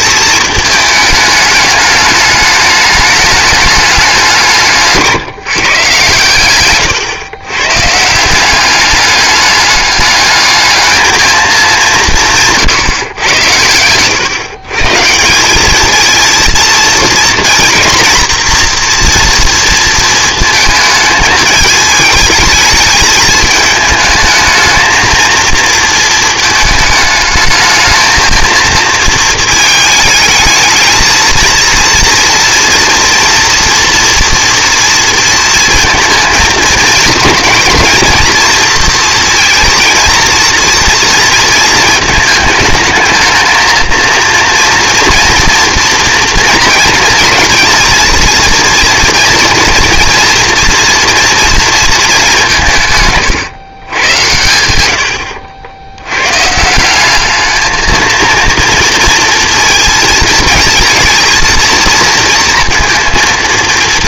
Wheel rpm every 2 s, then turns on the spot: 220, 210, 170, 120, 190, 220, 140, 140, 230, 240, 220, 220, 220, 220, 230, 220, 230, 230, 220, 230, 230, 220, 230, 230, 230, 230, 170, 80, 180, 230, 220, 230.
6-8